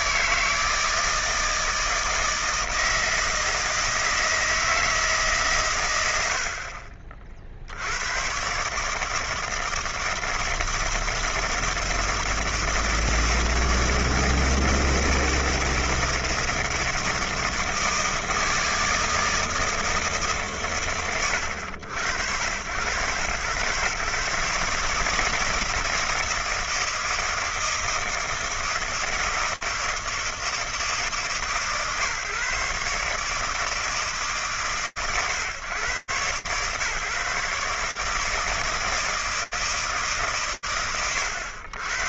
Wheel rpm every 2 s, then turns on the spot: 160, 160, 160, 50, 130, 160, 160, 160, 160, 160, 120, 90, 150, 160, 160, 160, 150, 140, 130, 160, 110.
none